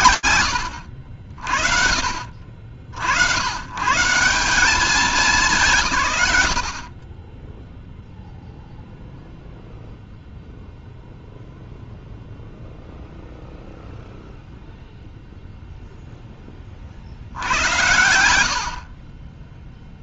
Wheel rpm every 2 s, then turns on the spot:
90, 80, 180, 20, 0, 0, 0, 0, 70, 40.
none